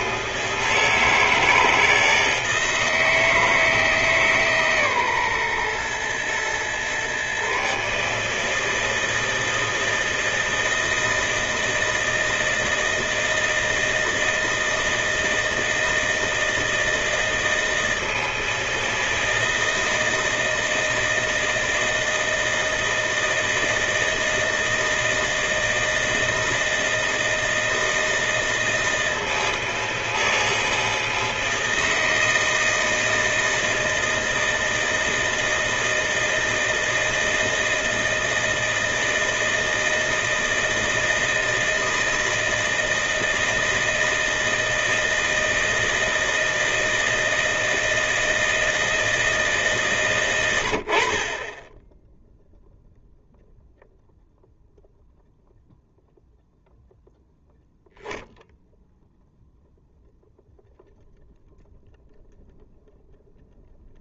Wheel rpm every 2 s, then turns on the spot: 160, 160, 140, 120, 160, 160, 160, 160, 160, 160, 160, 160, 160, 160, 160, 160, 160, 160, 160, 160, 160, 160, 160, 160, 160, 100, 0, 0, 0, 0, 0, 0.
none